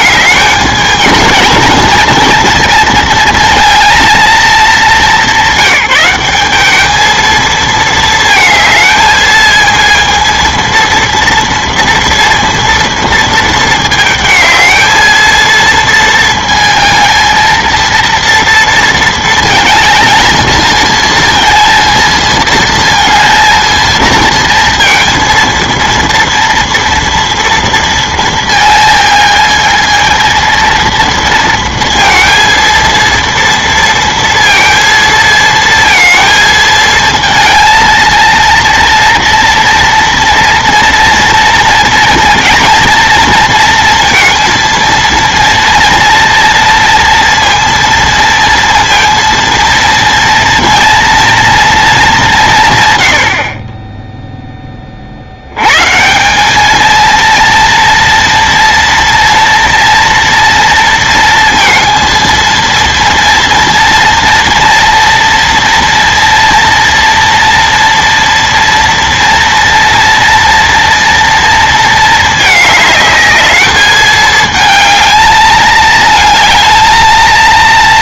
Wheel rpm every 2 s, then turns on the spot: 220, 230, 220, 210, 220, 230, 230, 220, 230, 230, 220, 230, 230, 230, 220, 230, 230, 230, 220, 230, 230, 230, 230, 230, 230, 230, 150, 20, 210, 230, 230, 230, 240, 230, 230, 230, 210, 220, 220.
none